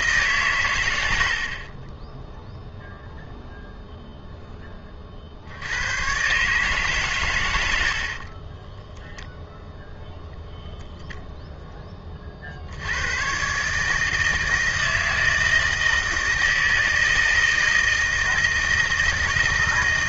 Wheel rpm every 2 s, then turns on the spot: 90, 0, 60, 130, 0, 0, 110, 160, 160, 160.
none